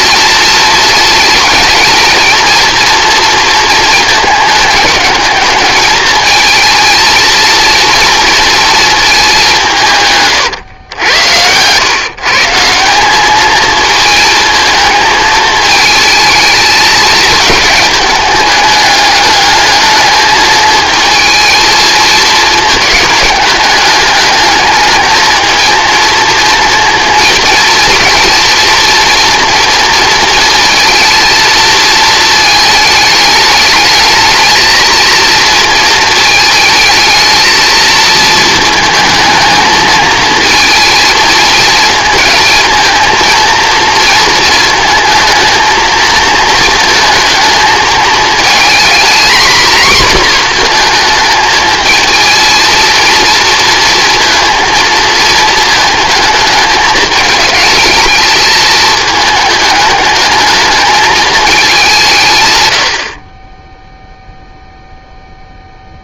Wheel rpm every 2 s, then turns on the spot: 220, 230, 200, 230, 220, 100, 190, 220, 220, 210, 220, 210, 220, 230, 230, 230, 210, 230, 220, 220, 230, 230, 220, 220, 230, 220, 230, 230, 210, 220, 220, 70, 0.
none